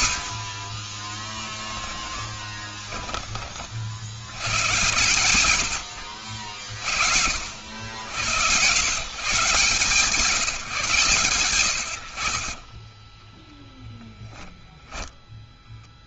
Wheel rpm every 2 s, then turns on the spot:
50, 20, 90, 60, 90, 150, 30, 10.
0-4 12-16